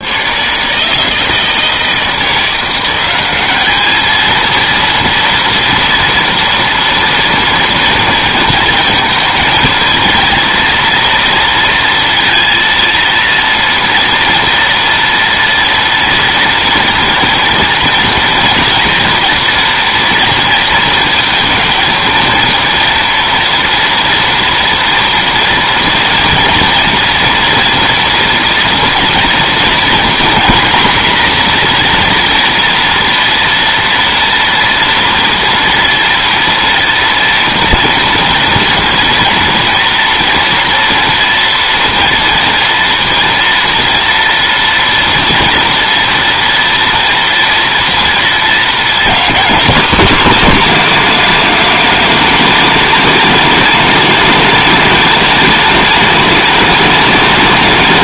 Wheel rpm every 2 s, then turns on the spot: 160, 190, 230, 230, 220, 230, 230, 240, 230, 230, 230, 230, 230, 230, 230, 240, 230, 230, 230, 230, 230, 230, 240, 230, 240, 260, 260, 260, 260.
none